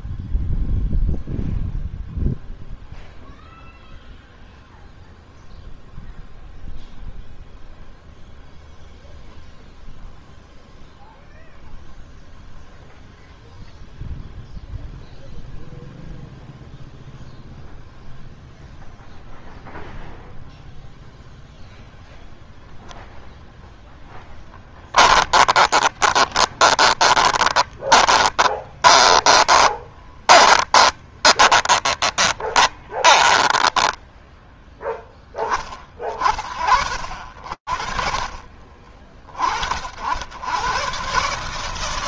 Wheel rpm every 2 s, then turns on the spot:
0, 0, 0, 0, 0, 0, 0, 0, 0, 0, 0, 0, 10, 20, 20, 20, 20, 10, 20, 40, 80.
26-36